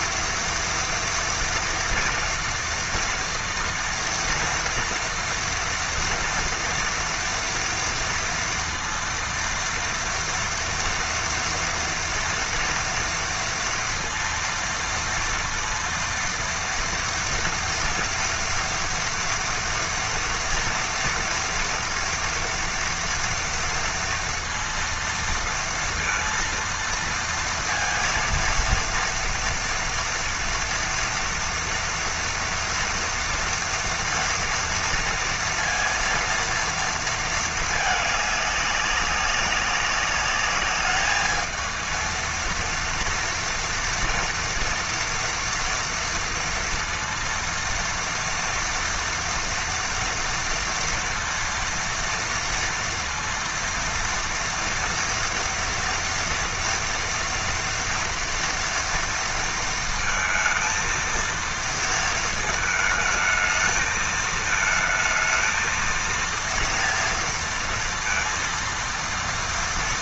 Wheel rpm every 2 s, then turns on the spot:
230, 230, 230, 230, 230, 230, 230, 230, 230, 230, 230, 230, 230, 230, 230, 230, 240, 230, 230, 200, 200, 230, 240, 230, 240, 230, 230, 230, 230, 230, 220, 220, 220, 230, 230.
none